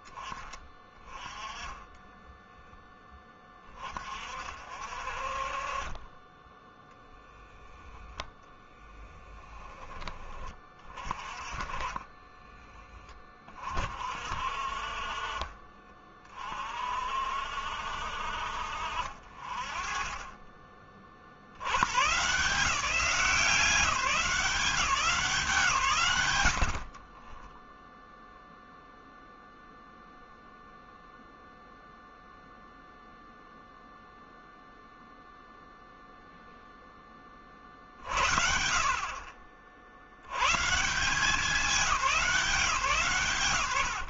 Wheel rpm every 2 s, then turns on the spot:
20, 10, 50, 10, 10, 30, 20, 40, 40, 50, 40, 180, 160, 40, 0, 0, 0, 0, 10, 60, 150, 130.
none